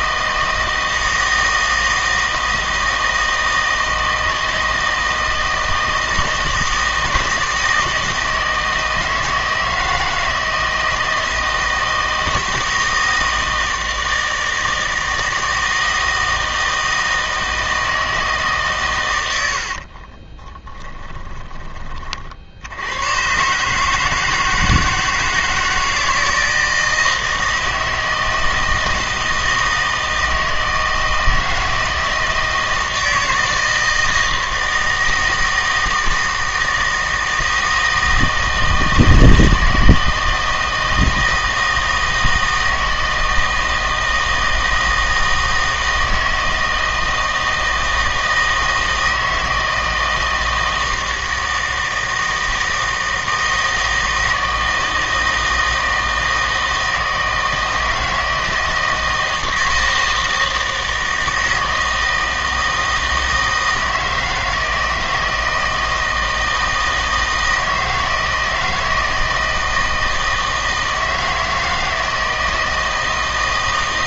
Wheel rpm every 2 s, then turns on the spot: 160, 160, 160, 160, 160, 160, 160, 160, 160, 140, 20, 80, 160, 160, 160, 160, 160, 160, 160, 160, 160, 160, 160, 160, 160, 160, 160, 160, 160, 160, 160, 160, 160, 160, 160, 160, 160.
20-22